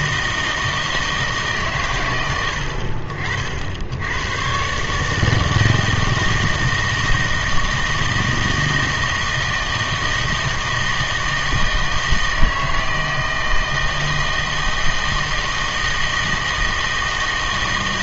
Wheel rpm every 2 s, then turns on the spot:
160, 80, 130, 160, 160, 160, 160, 160, 160.
none